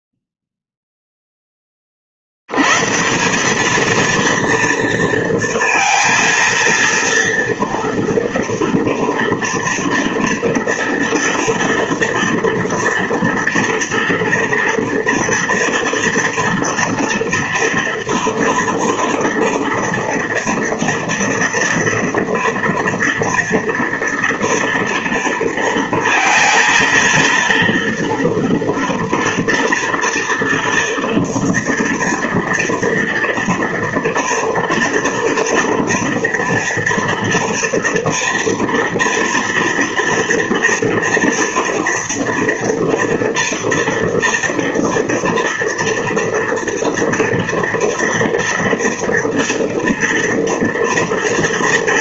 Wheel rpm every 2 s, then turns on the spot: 0, 90, 230, 230, 240, 230, 230, 230, 230, 230, 240, 240, 230, 230, 230, 230, 230, 230, 240, 230, 230, 230, 230, 230, 230, 240.
none